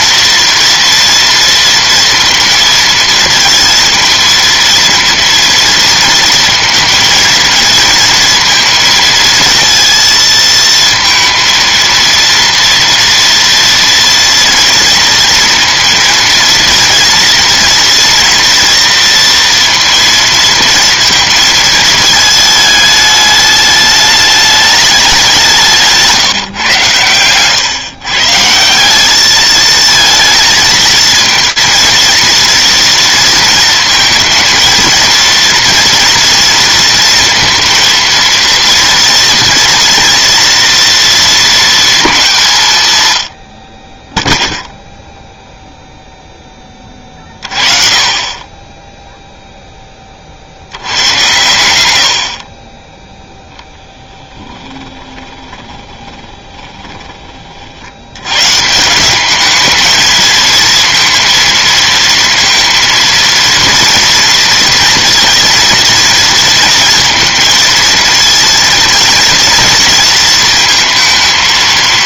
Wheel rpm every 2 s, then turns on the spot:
230, 230, 230, 230, 230, 230, 230, 230, 240, 230, 230, 210, 200, 110, 210, 230, 230, 230, 230, 230, 230, 140, 0, 20, 10, 90, 20, 20, 20, 160, 230, 230, 230, 230, 230, 220.
54-58